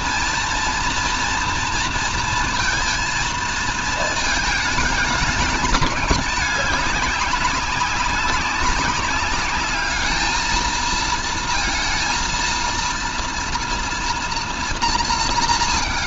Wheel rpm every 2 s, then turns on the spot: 230, 230, 220, 200, 190, 220, 230, 230.
none